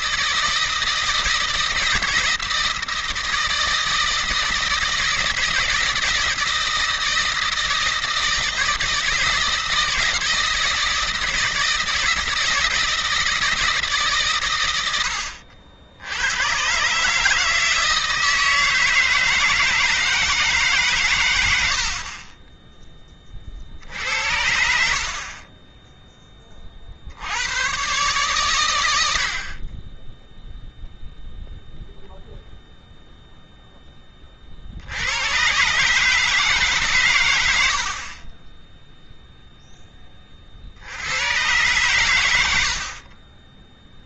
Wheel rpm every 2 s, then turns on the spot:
160, 160, 160, 160, 160, 160, 160, 120, 120, 160, 150, 30, 60, 40, 100, 0, 0, 70, 150, 10, 60, 70.
22-24